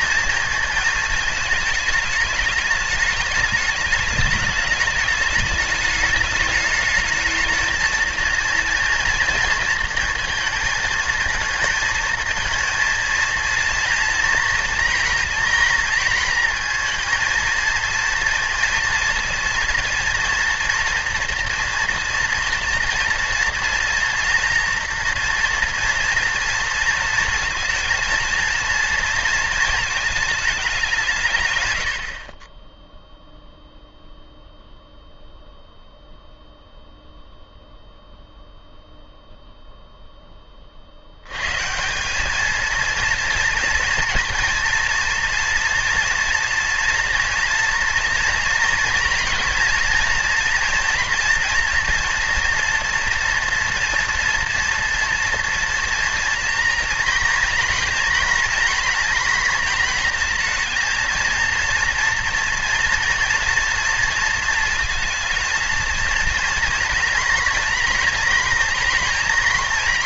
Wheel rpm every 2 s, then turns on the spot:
230, 210, 210, 220, 230, 230, 220, 230, 230, 230, 230, 230, 230, 230, 230, 190, 10, 0, 0, 0, 50, 220, 230, 240, 240, 230, 230, 230, 230, 230, 230, 230, 230, 230, 230.
none